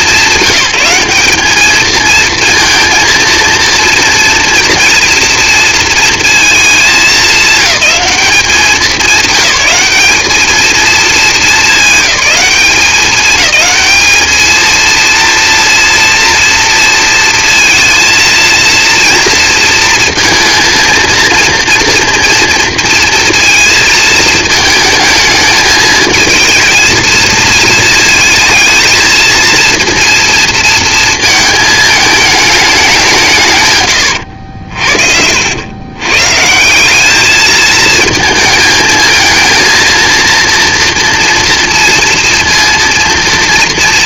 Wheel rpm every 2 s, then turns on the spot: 190, 230, 240, 220, 200, 220, 200, 220, 230, 230, 230, 230, 220, 220, 230, 230, 190, 60, 190, 220, 230, 230.
none